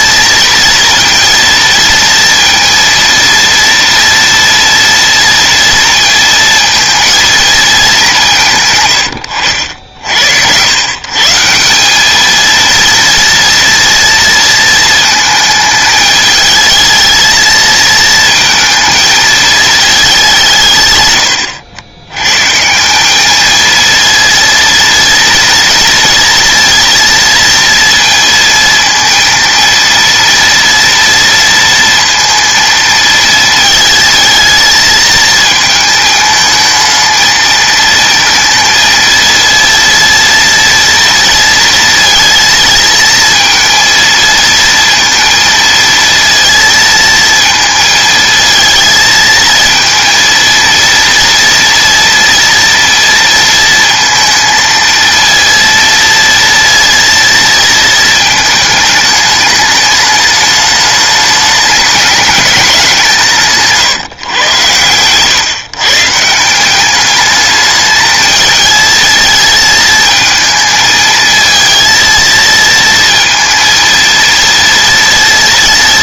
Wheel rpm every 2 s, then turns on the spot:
230, 230, 230, 230, 130, 100, 230, 230, 220, 220, 140, 160, 230, 230, 230, 230, 230, 220, 220, 230, 230, 230, 230, 230, 220, 230, 230, 230, 230, 220, 210, 190, 110, 180, 220, 220, 230, 230.
none